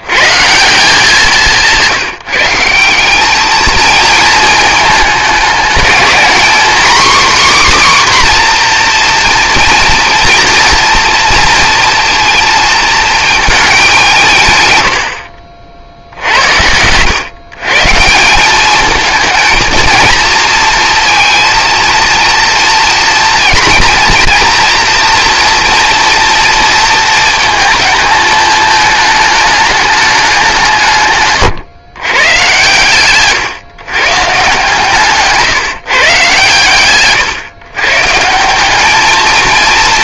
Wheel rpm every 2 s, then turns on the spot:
180, 180, 210, 260, 240, 230, 230, 100, 100, 210, 230, 230, 240, 230, 220, 150, 130, 140, 130, 220.
34-36